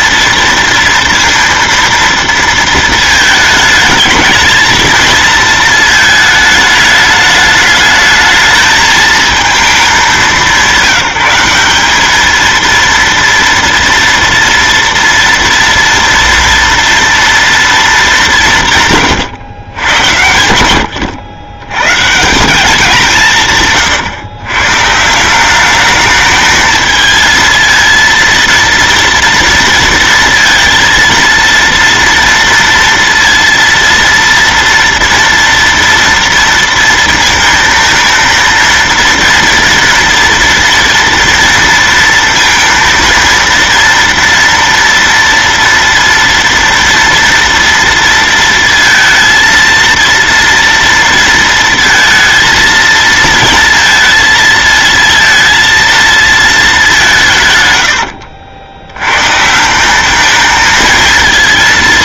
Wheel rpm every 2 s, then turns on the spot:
230, 230, 220, 220, 220, 180, 220, 230, 230, 160, 90, 190, 120, 220, 230, 230, 230, 230, 230, 230, 230, 230, 230, 230, 230, 230, 230, 230, 220, 60, 220.
none